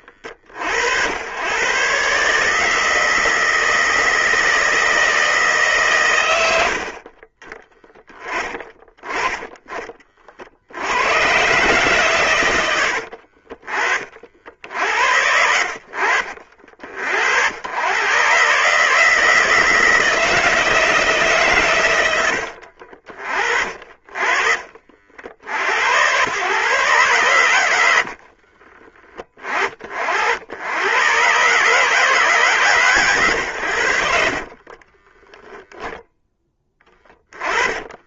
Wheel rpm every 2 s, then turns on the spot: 80, 160, 160, 50, 20, 100, 80, 70, 60, 150, 160, 50, 50, 130, 20, 110, 130, 20, 10.
12-14 34-38